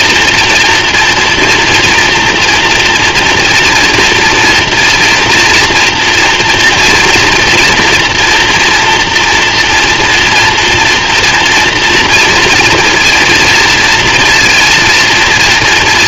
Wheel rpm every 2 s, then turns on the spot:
240, 240, 230, 230, 230, 230, 230, 230.
none